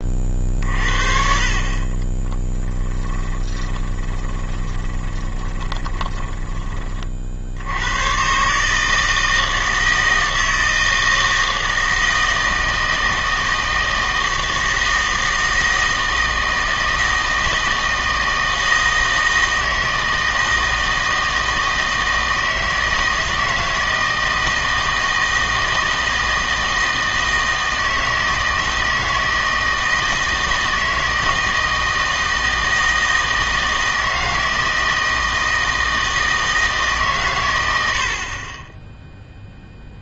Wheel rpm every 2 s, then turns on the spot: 50, 20, 20, 30, 150, 160, 160, 160, 160, 160, 160, 160, 160, 160, 160, 160, 160, 160, 150, 10.
2-6